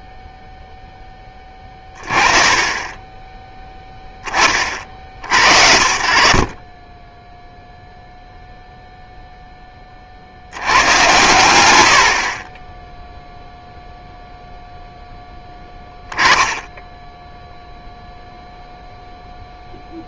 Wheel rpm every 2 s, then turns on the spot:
0, 20, 60, 10, 0, 100, 10, 0, 10, 0.
none